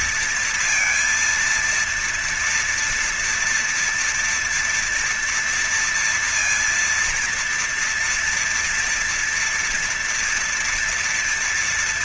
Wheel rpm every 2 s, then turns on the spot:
230, 230, 230, 230, 240, 230.
none